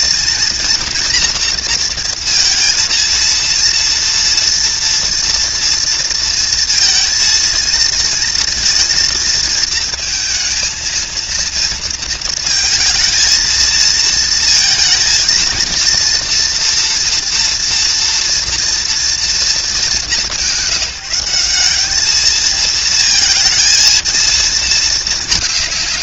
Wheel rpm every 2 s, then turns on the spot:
230, 230, 230, 230, 230, 230, 220, 230, 230, 230, 190, 220, 220.
none